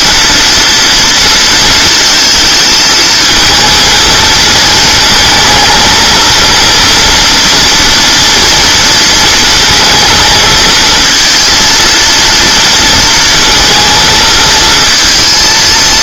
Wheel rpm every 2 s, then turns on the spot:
230, 220, 220, 230, 230, 230, 230, 230.
none